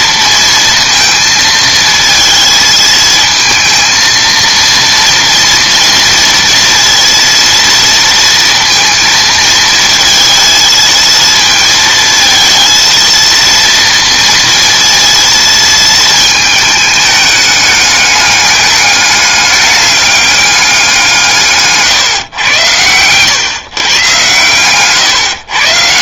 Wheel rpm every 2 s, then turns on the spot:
230, 220, 230, 230, 230, 220, 220, 230, 220, 210, 190, 110, 120.
none